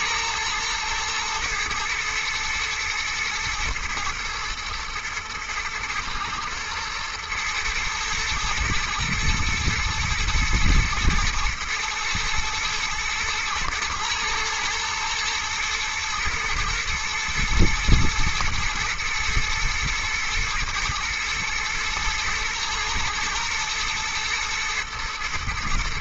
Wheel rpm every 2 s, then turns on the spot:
110, 110, 110, 120, 110, 110, 110, 110, 120, 120, 110, 110, 110.
none